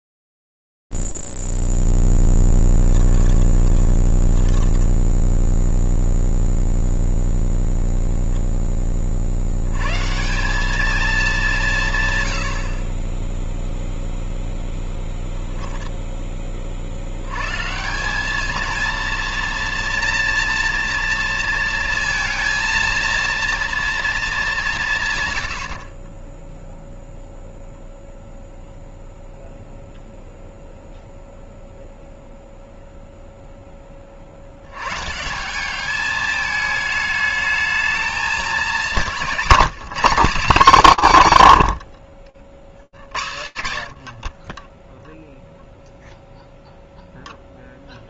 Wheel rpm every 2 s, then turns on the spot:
40, 0, 20, 0, 0, 130, 130, 0, 10, 200, 230, 230, 210, 10, 0, 0, 0, 130, 210, 190, 190, 80, 0, 0.
4-6